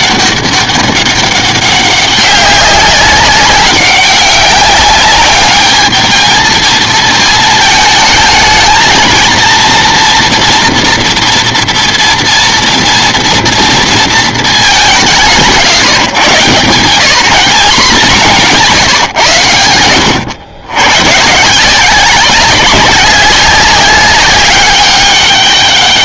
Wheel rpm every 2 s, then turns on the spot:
200, 190, 190, 210, 220, 230, 230, 230, 140, 190, 100, 160, 200.
none